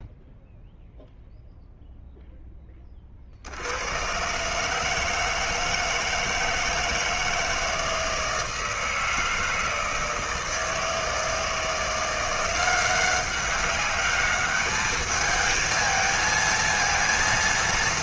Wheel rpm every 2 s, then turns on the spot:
0, 10, 140, 160, 160, 160, 180, 210, 230.
none